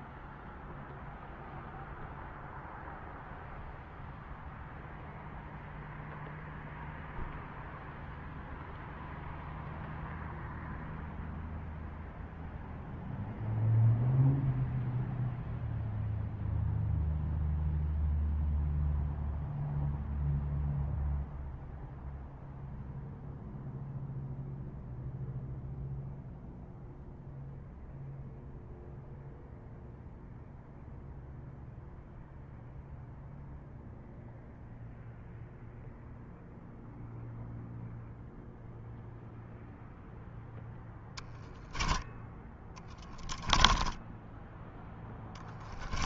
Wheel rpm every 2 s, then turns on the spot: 0, 0, 0, 0, 0, 0, 0, 0, 0, 0, 0, 0, 0, 0, 0, 0, 0, 0, 0, 0, 0, 10, 10.
42-46